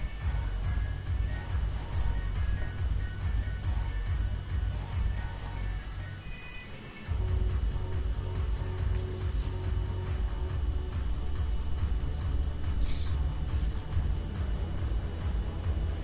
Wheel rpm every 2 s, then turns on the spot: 0, 0, 0, 0, 0, 0, 0, 0.
none